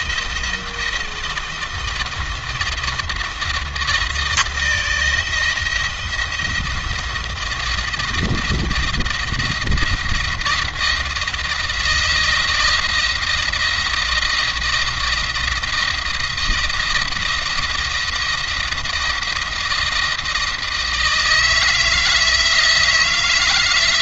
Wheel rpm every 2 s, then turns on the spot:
170, 170, 170, 170, 170, 160, 160, 170, 170, 160, 160, 160.
none